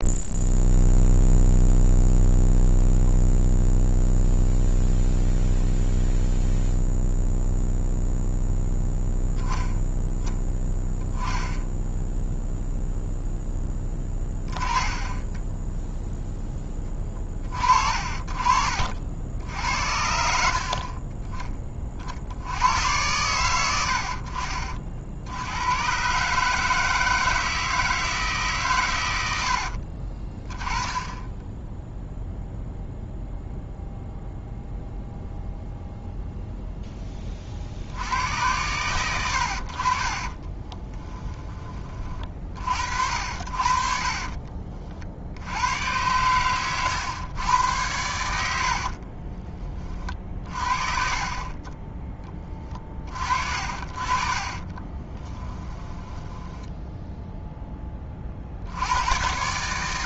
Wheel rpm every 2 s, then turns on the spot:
0, 0, 0, 0, 0, 10, 0, 10, 20, 60, 30, 90, 50, 160, 120, 20, 0, 0, 0, 100, 20, 40, 40, 110, 60, 40, 40, 20, 10, 80.
14-16 40-42 48-50 54-58